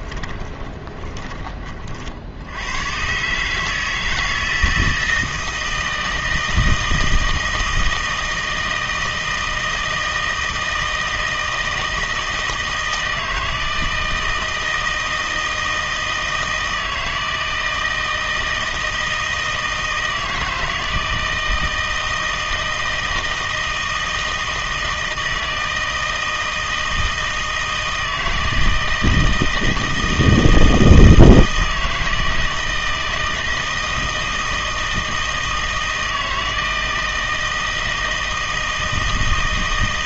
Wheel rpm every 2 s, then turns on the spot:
20, 100, 160, 160, 160, 160, 160, 160, 160, 160, 160, 160, 160, 160, 160, 160, 160, 160, 160, 160.
0-2